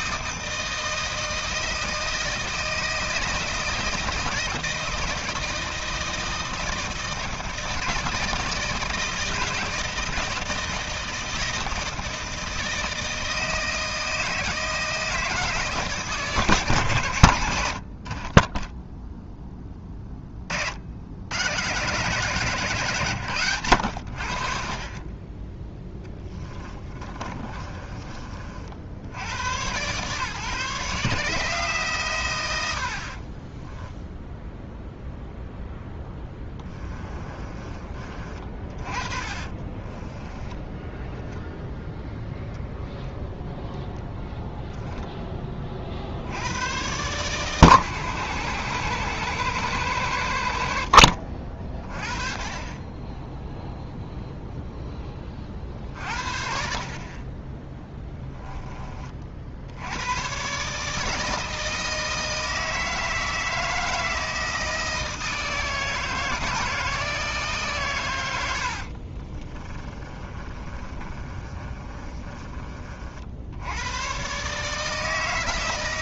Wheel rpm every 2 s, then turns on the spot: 160, 160, 160, 160, 160, 160, 160, 160, 130, 10, 70, 150, 30, 20, 60, 150, 70, 0, 20, 50, 10, 0, 0, 120, 120, 70, 20, 10, 40, 20, 140, 160, 160, 160, 60, 30, 40, 150.
26-28 36-42 68-72